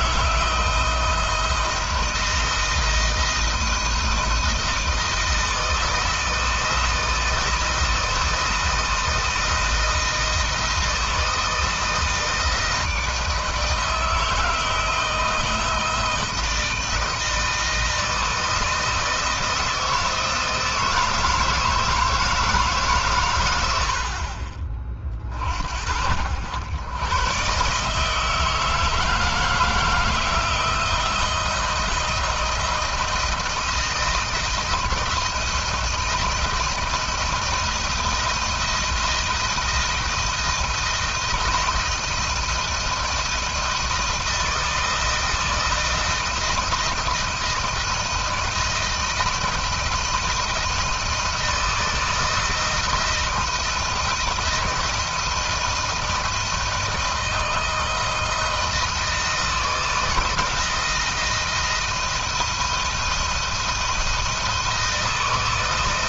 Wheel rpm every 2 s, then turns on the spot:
170, 160, 160, 160, 160, 160, 160, 160, 160, 160, 160, 150, 30, 100, 160, 170, 170, 170, 160, 170, 170, 160, 160, 160, 160, 160, 160, 170, 160, 160, 160, 170, 160.
none